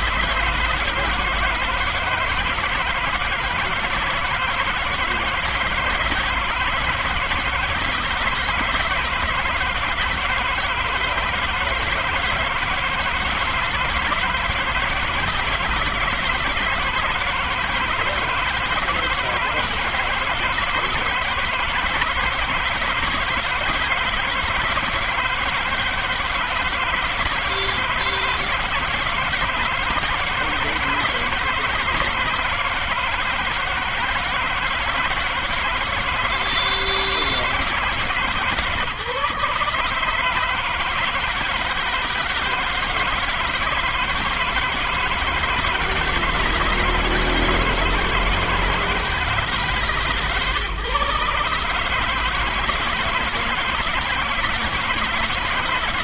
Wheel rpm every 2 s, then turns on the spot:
160, 160, 150, 160, 160, 160, 160, 160, 160, 160, 160, 170, 160, 160, 160, 160, 170, 160, 160, 140, 160, 160, 160, 160, 160, 140, 160, 170.
none